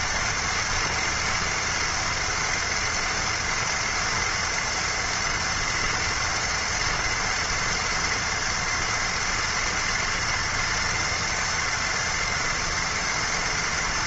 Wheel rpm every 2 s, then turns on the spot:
230, 240, 240, 230, 230, 230, 230.
none